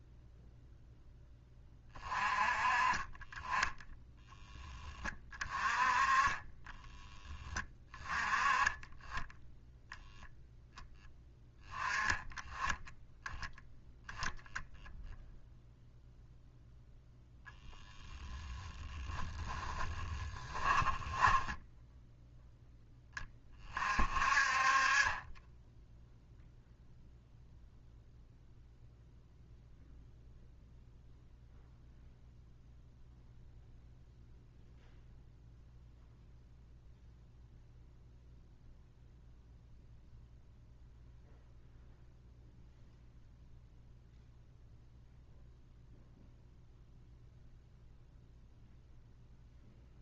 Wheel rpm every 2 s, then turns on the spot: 0, 30, 10, 20, 10, 0, 10, 0, 0, 10, 20, 0, 30, 0, 0, 0, 0, 0, 0, 0, 0, 0, 0, 0, 0.
6-8 18-22